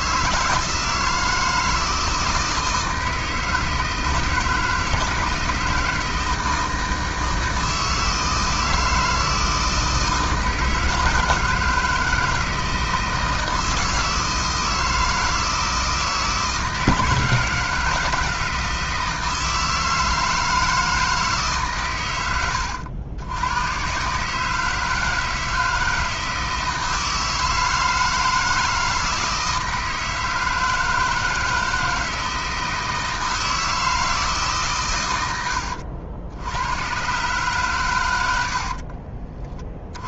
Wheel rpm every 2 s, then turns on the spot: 160, 160, 160, 160, 160, 160, 160, 160, 160, 160, 160, 90, 160, 160, 160, 160, 160, 120, 110, 50.
38-40